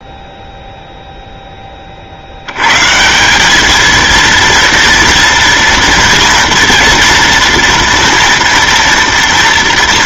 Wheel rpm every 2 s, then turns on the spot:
0, 100, 230, 230, 230.
none